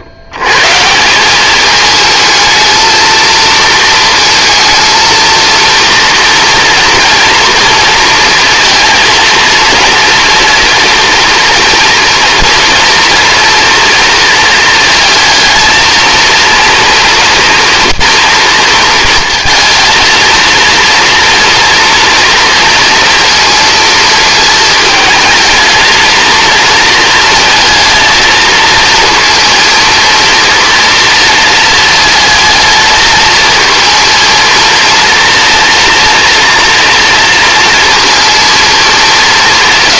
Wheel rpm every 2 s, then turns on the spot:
150, 220, 230, 230, 230, 240, 240, 230, 240, 230, 230, 230, 220, 230, 220, 230, 220, 230, 230, 220.
none